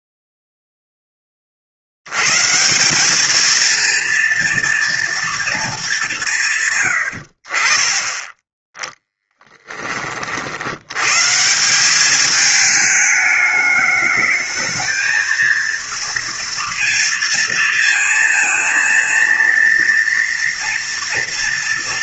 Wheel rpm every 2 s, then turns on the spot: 0, 160, 230, 160, 10, 90, 210, 220, 230, 230, 230.
none